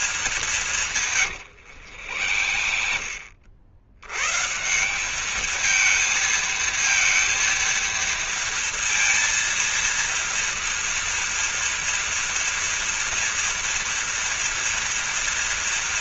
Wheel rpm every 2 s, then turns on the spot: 150, 70, 180, 230, 230, 230, 230, 230.
0-4